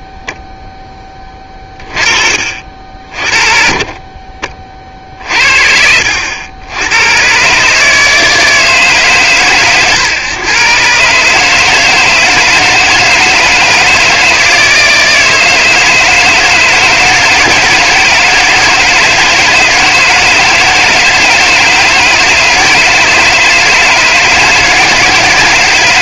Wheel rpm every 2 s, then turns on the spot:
10, 50, 50, 90, 160, 130, 160, 160, 160, 160, 160, 160, 160.
none